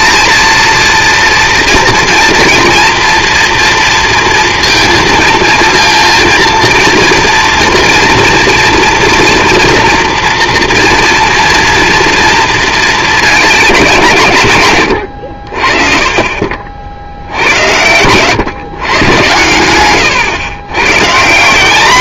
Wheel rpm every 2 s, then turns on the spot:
230, 230, 230, 230, 230, 240, 230, 100, 60, 120, 120.
none